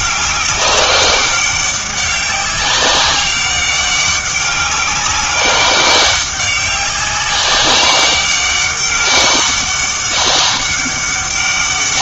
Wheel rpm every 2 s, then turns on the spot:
200, 190, 200, 190, 200, 200.
none